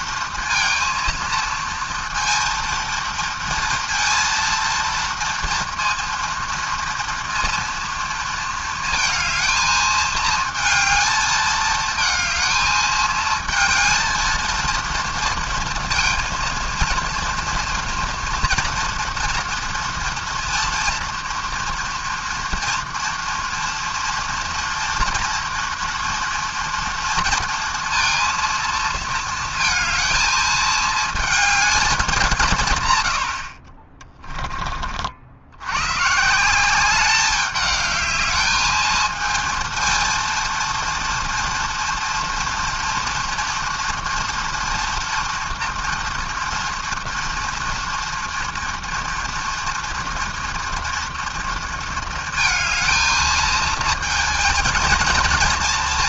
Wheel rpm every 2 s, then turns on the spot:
230, 230, 230, 230, 220, 220, 220, 230, 230, 230, 230, 230, 230, 230, 230, 220, 150, 30, 180, 220, 230, 230, 240, 230, 230, 230, 230, 230.
none